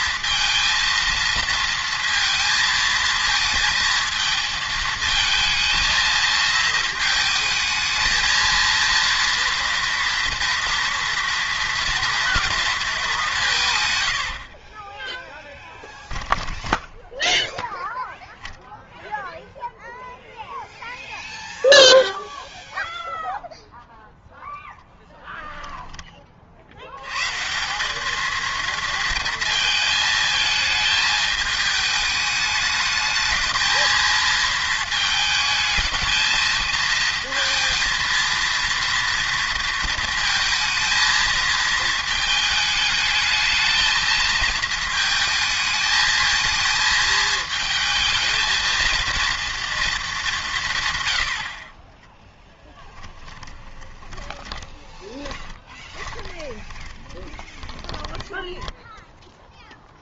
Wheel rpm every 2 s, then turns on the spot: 230, 220, 220, 220, 230, 230, 230, 40, 10, 0, 0, 0, 0, 60, 230, 220, 210, 220, 220, 230, 230, 210, 220, 230, 230, 150, 10, 20, 20, 10.
14-18 52-60